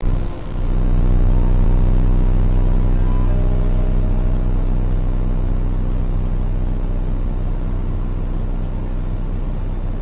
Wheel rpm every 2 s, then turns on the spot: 0, 0, 0, 0, 0.
none